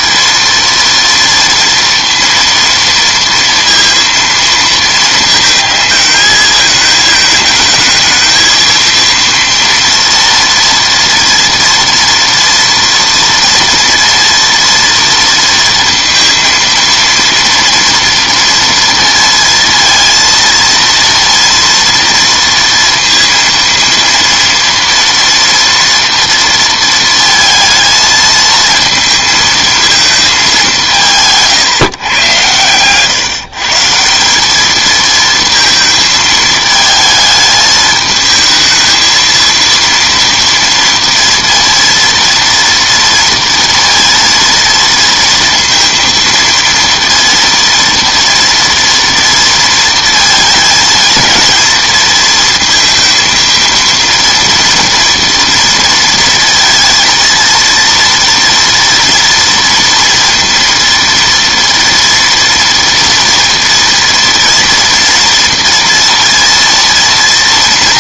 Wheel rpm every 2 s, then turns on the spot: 230, 230, 230, 220, 220, 230, 230, 230, 230, 230, 230, 230, 230, 230, 220, 200, 110, 200, 220, 220, 230, 230, 230, 230, 230, 230, 230, 230, 230, 230, 230, 230, 230, 230.
none